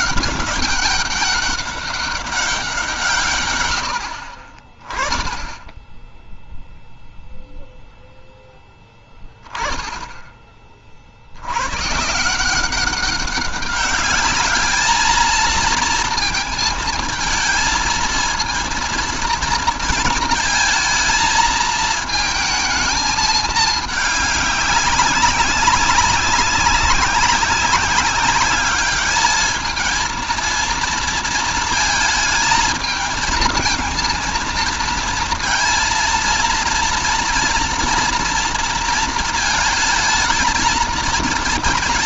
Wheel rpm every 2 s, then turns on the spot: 200, 90, 10, 0, 10, 120, 200, 230, 220, 220, 220, 210, 190, 190, 220, 220, 220, 230, 240, 220, 240.
none